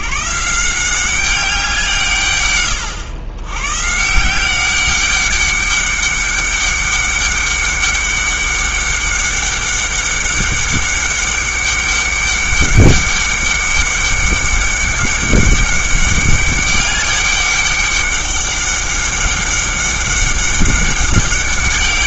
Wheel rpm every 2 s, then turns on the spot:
170, 110, 190, 200, 200, 200, 200, 200, 200, 200, 200.
none